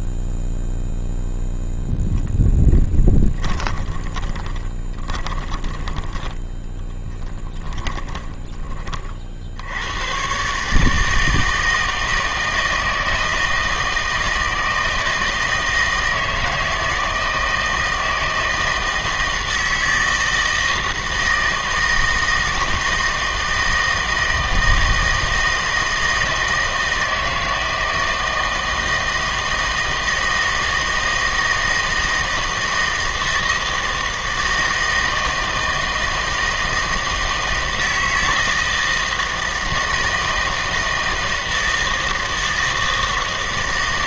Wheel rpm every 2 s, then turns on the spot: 0, 0, 20, 10, 20, 120, 160, 160, 160, 160, 160, 160, 160, 160, 160, 160, 160, 160, 160, 160, 160, 160.
4-10